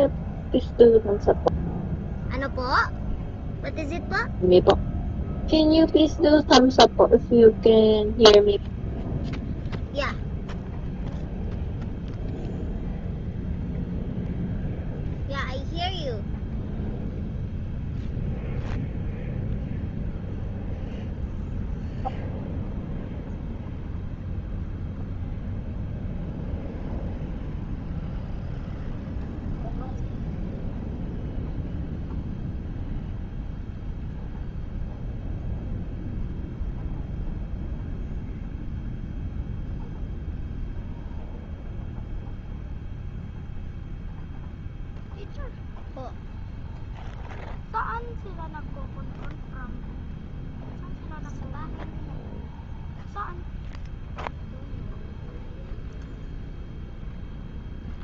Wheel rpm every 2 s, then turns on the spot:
0, 0, 0, 0, 0, 0, 0, 0, 0, 0, 0, 0, 0, 0, 0, 0, 0, 0, 0, 0, 0, 0, 0, 0, 0, 0, 0, 0, 0.
none